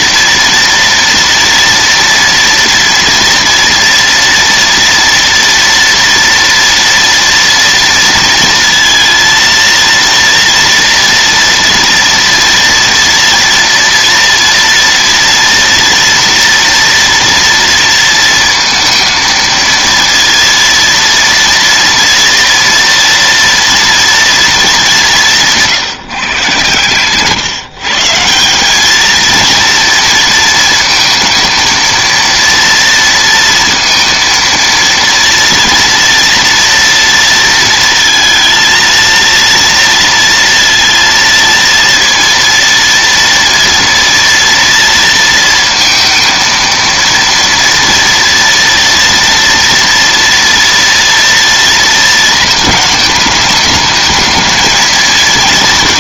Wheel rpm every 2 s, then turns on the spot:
230, 230, 230, 230, 230, 230, 240, 240, 230, 230, 230, 230, 170, 130, 220, 220, 230, 230, 230, 230, 230, 230, 230, 230, 230, 230, 210, 220.
none